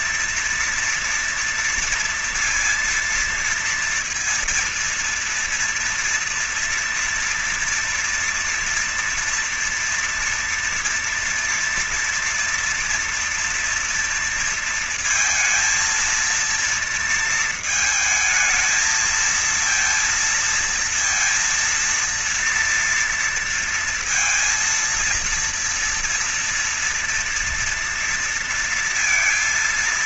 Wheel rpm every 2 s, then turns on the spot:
230, 230, 230, 230, 230, 230, 240, 230, 230, 220, 230, 230, 230, 230, 230.
none